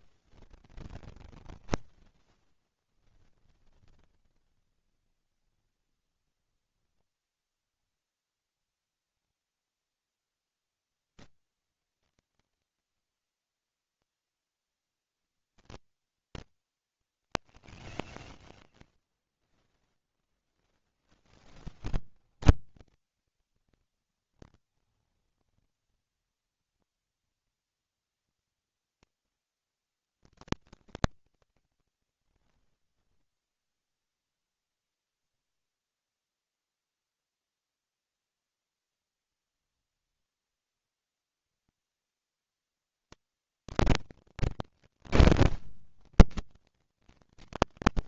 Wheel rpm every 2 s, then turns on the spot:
70, 30, 60, 70, 70, 110, 120, 150, 160, 120, 10, 60, 90, 110, 110, 110, 80, 20, 20, 80, 90, 110, 140, 120.
32-38